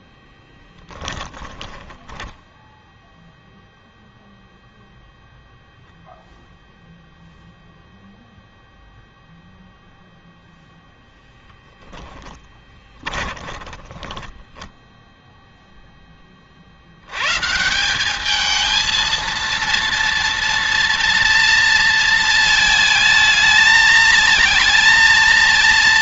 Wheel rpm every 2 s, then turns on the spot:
10, 0, 0, 0, 0, 0, 10, 0, 80, 220, 230, 220, 220.
0-2 12-14